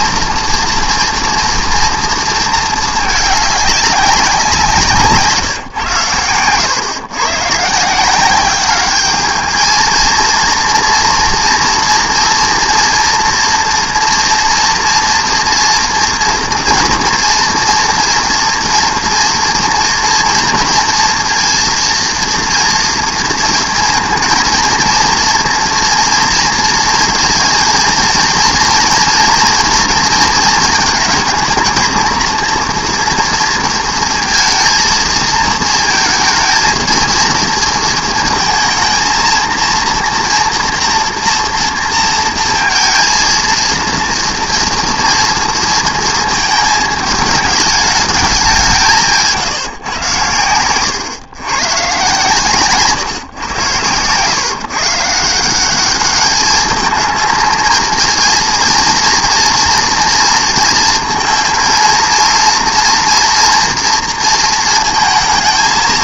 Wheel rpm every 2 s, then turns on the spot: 230, 220, 170, 110, 200, 240, 230, 230, 230, 230, 240, 230, 230, 230, 230, 220, 230, 230, 220, 230, 240, 230, 230, 220, 180, 110, 140, 140, 220, 230, 230, 230, 220.
50-52